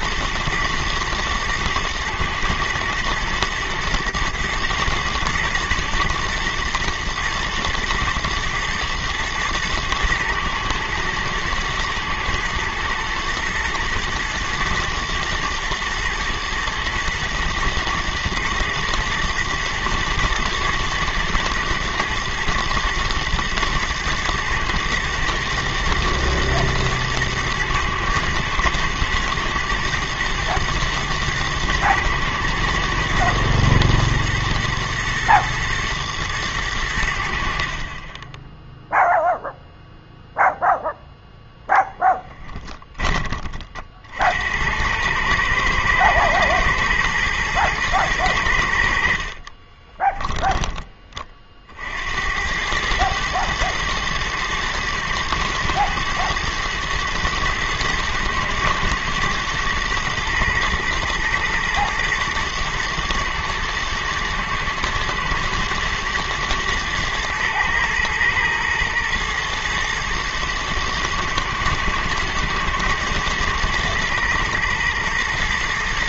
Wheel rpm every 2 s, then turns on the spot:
120, 110, 120, 120, 120, 110, 120, 110, 110, 110, 120, 120, 120, 110, 110, 120, 110, 110, 90, 0, 0, 10, 90, 120, 70, 20, 100, 110, 110, 110, 110, 110, 110, 120, 110, 110, 110, 120.
none